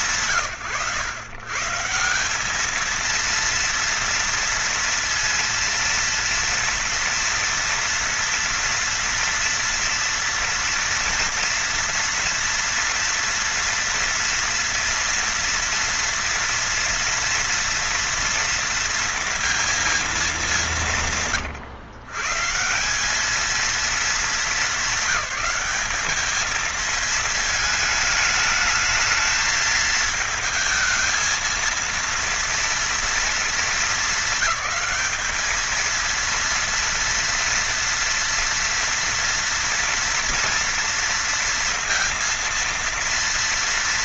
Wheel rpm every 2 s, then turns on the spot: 150, 220, 230, 230, 230, 230, 230, 230, 240, 230, 180, 170, 200, 220, 220, 220, 240, 210, 230, 230, 230, 230.
none